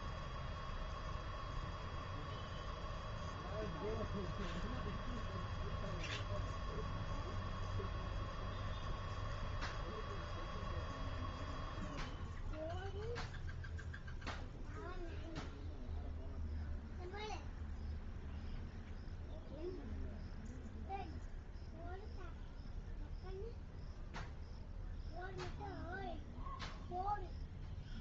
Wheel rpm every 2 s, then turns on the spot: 0, 0, 0, 0, 0, 0, 0, 0, 0, 0, 0, 0, 0, 0.
none